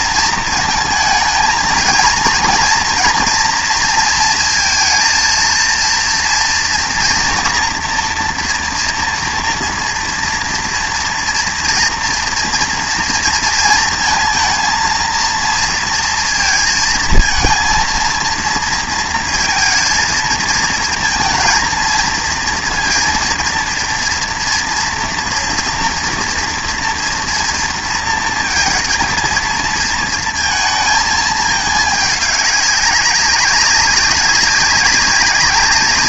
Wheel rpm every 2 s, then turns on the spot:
230, 240, 230, 240, 240, 240, 240, 230, 230, 230, 220, 230, 230, 230, 230, 230, 200, 200.
none